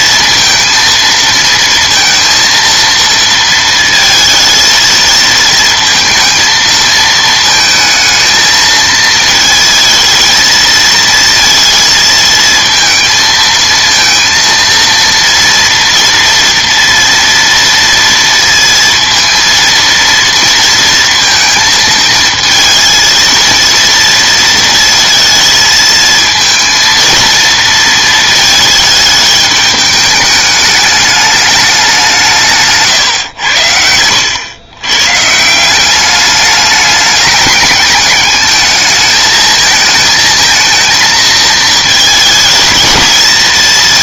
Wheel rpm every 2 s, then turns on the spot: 230, 230, 220, 220, 220, 230, 230, 230, 230, 230, 230, 230, 230, 220, 220, 210, 150, 120, 210, 210, 220, 220.
none